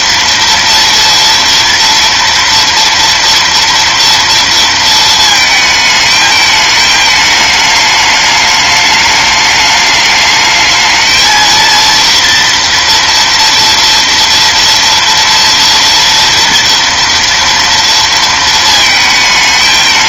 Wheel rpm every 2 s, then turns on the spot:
230, 230, 230, 220, 210, 220, 230, 240, 230, 230.
none